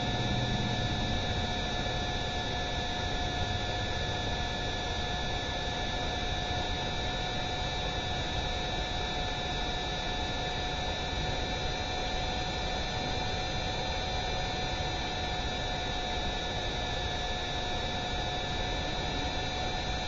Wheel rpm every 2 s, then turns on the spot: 0, 0, 0, 0, 0, 0, 0, 0, 0, 0.
none